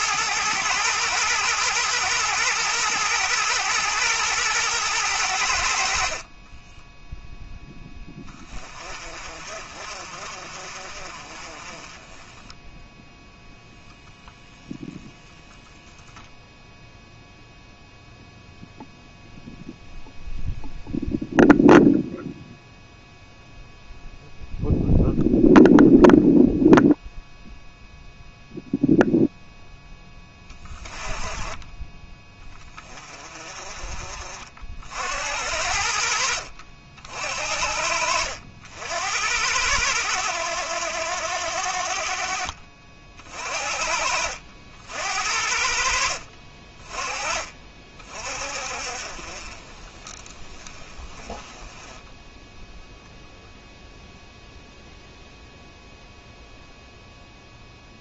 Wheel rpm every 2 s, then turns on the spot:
110, 120, 110, 10, 30, 40, 10, 0, 0, 0, 0, 0, 0, 0, 0, 20, 20, 60, 50, 80, 80, 40, 70, 30, 50, 20, 0, 0, 0.
6-8 42-44